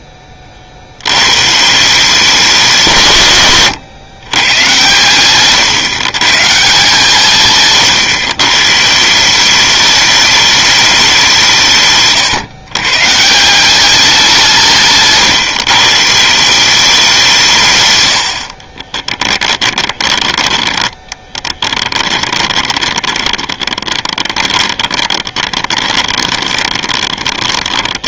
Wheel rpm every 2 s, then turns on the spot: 60, 170, 120, 160, 160, 200, 140, 160, 190, 20, 10, 20, 20, 20.
18-28